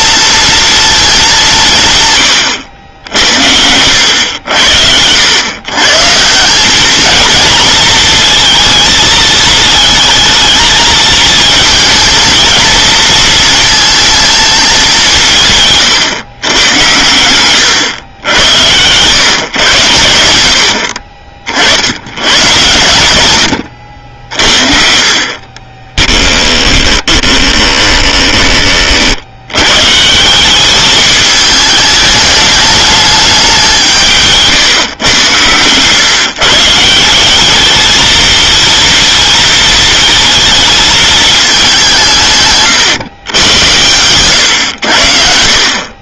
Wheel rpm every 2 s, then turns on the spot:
230, 100, 80, 190, 230, 220, 220, 210, 110, 100, 70, 120, 50, 20, 30, 190, 210, 140, 150, 230, 220, 130, 100.
26-28